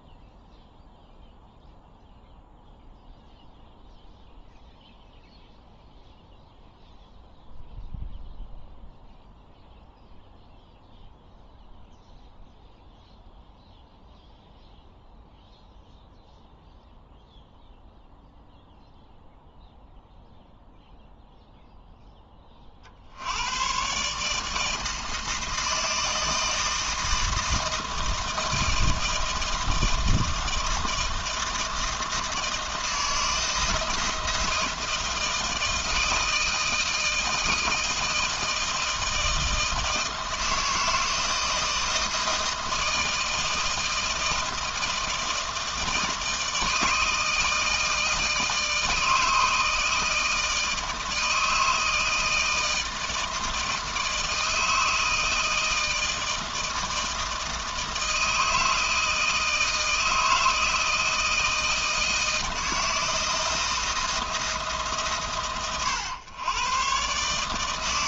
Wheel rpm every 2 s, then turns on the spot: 0, 0, 0, 0, 0, 0, 0, 0, 0, 0, 0, 50, 160, 160, 160, 160, 160, 160, 160, 160, 160, 160, 160, 160, 160, 160, 160, 160, 160, 160, 160, 160, 140, 130.
none